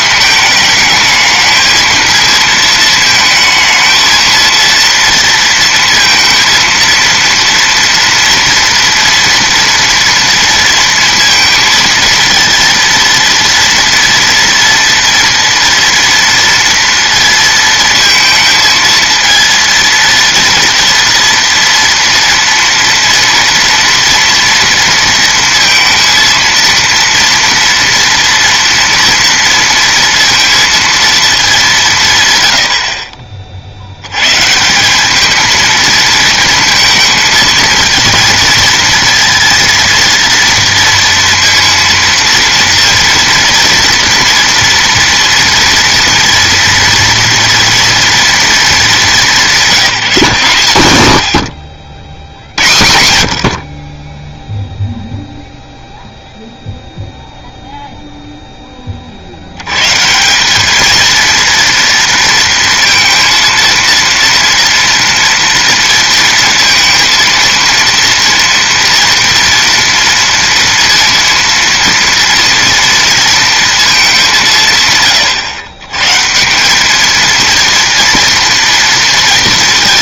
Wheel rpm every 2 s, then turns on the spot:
220, 220, 230, 230, 230, 230, 230, 230, 230, 230, 230, 230, 230, 230, 230, 220, 40, 200, 230, 230, 230, 230, 230, 230, 200, 130, 70, 0, 0, 20, 220, 230, 230, 230, 230, 230, 230, 140, 210, 230.
none